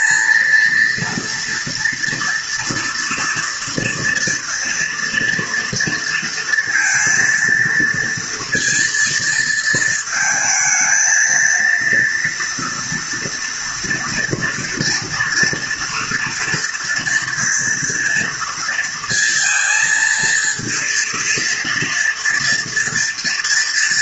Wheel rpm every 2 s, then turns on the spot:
230, 240, 230, 230, 230, 220, 230, 230, 230, 230, 230, 230.
none